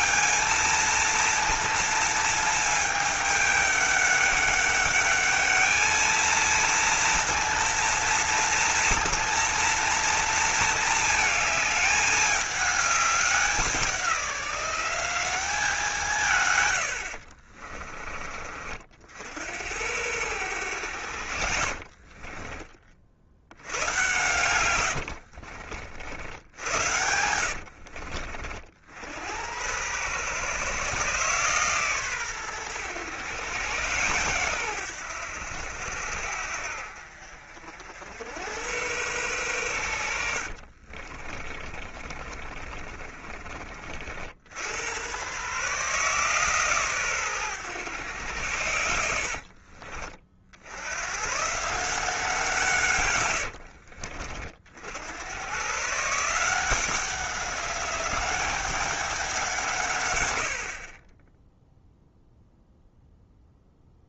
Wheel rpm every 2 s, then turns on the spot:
230, 220, 200, 230, 230, 220, 210, 180, 100, 50, 90, 40, 110, 90, 60, 130, 120, 110, 60, 100, 50, 30, 80, 140, 90, 80, 140, 60, 180, 200, 50, 0.
24-28 40-44